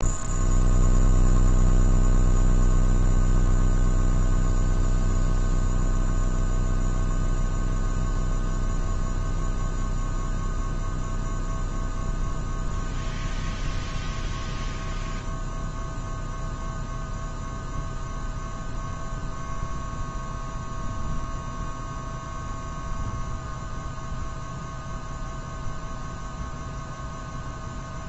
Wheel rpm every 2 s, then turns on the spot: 0, 0, 0, 0, 0, 0, 0, 0, 0, 0, 0, 0, 0, 0.
none